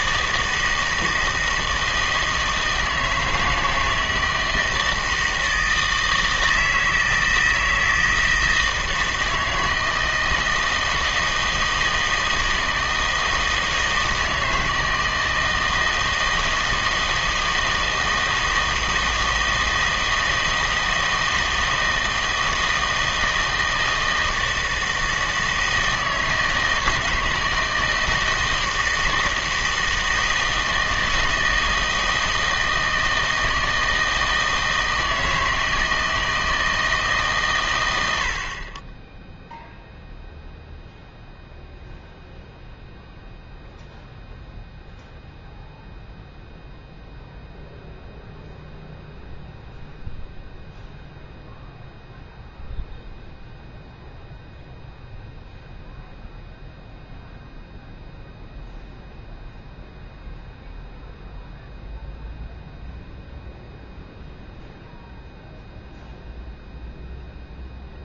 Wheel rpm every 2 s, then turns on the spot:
160, 160, 160, 160, 160, 160, 160, 160, 160, 160, 160, 160, 160, 160, 160, 160, 160, 160, 160, 30, 0, 0, 0, 0, 0, 0, 0, 0, 0, 0, 0, 0, 0, 0.
none